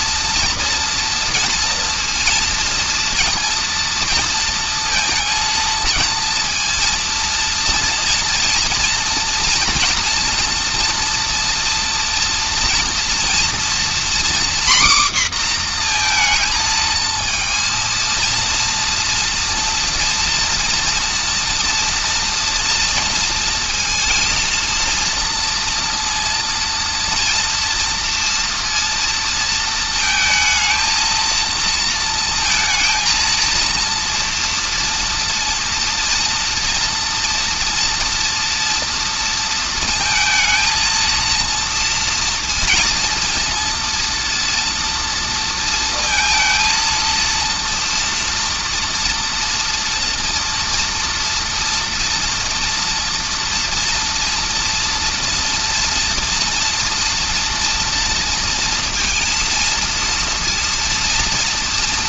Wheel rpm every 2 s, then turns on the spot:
230, 230, 230, 230, 230, 230, 230, 250, 230, 230, 230, 230, 230, 230, 230, 230, 230, 230, 230, 230, 230, 230, 230, 230, 230, 230, 230, 230, 230, 230, 230.
none